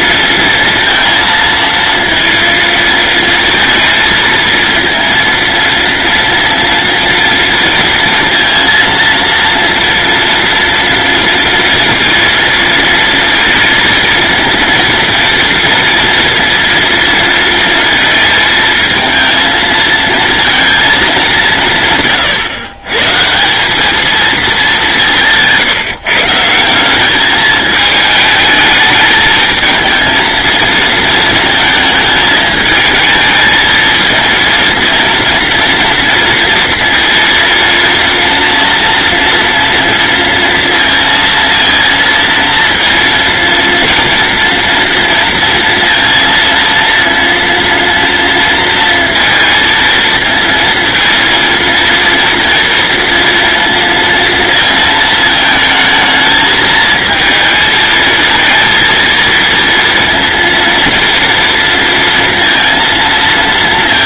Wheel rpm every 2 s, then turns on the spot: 230, 230, 230, 230, 230, 240, 230, 230, 230, 220, 230, 130, 200, 180, 210, 230, 220, 230, 230, 240, 230, 230, 230, 230, 230, 230, 230, 230, 220, 230, 230, 230.
none